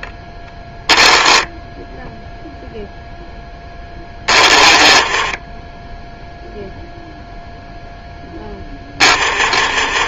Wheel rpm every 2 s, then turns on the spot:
10, 0, 20, 0, 10.
0-2 4-6